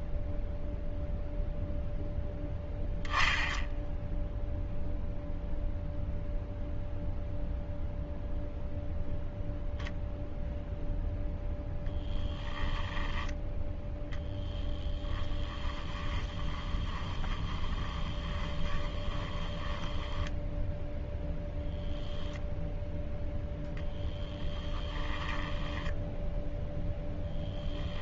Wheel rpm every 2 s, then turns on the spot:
0, 10, 0, 0, 0, 0, 10, 10, 20, 20, 10, 0, 20, 0.
12-20 24-26